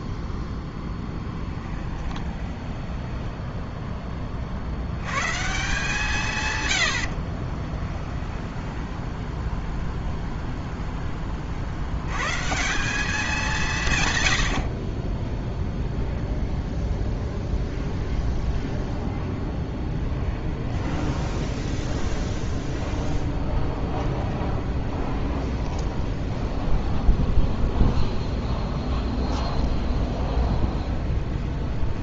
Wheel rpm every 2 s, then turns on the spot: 10, 10, 60, 100, 10, 0, 170, 50, 0, 0, 10, 0, 20, 20, 20, 20.
2-4 8-10 20-22 24-32